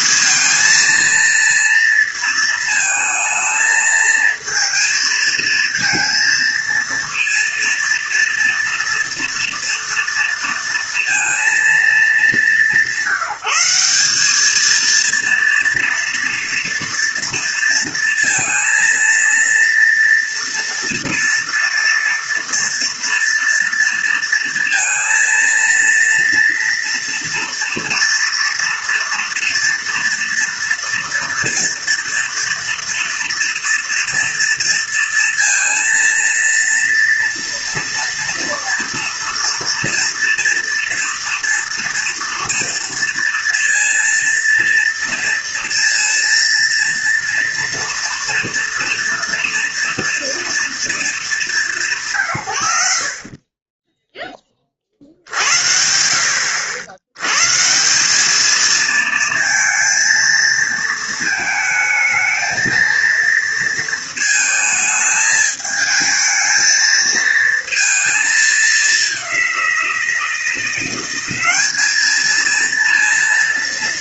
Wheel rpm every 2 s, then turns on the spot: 220, 230, 230, 230, 230, 230, 200, 210, 230, 230, 230, 240, 230, 230, 230, 230, 230, 230, 230, 230, 230, 230, 230, 230, 230, 230, 100, 20, 70, 220, 230, 220, 220, 220, 220, 170, 220.
none